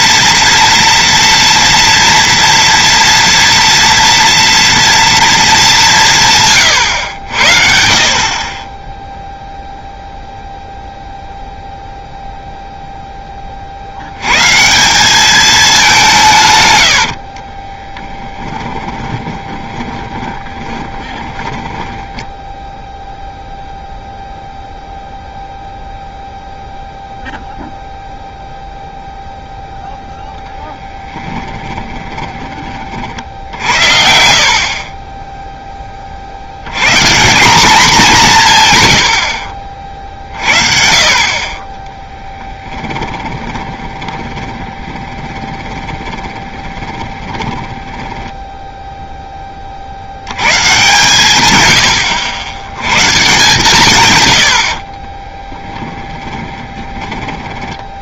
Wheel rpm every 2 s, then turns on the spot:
230, 230, 230, 130, 20, 0, 0, 150, 120, 10, 20, 10, 0, 0, 0, 10, 30, 40, 90, 150, 50, 10, 20, 20, 10, 110, 100, 80, 20.
18-22 30-32 34-36 42-50 54-58